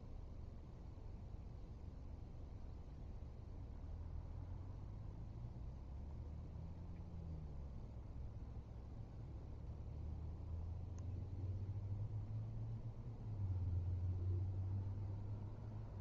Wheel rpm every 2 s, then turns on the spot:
0, 0, 0, 0, 0, 0, 0, 0.
none